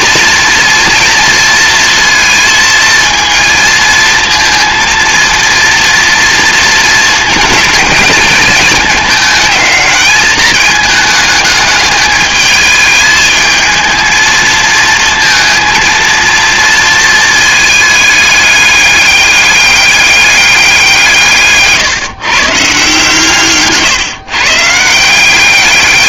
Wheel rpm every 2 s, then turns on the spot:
230, 230, 230, 220, 210, 210, 210, 220, 230, 210, 190, 150, 160.
none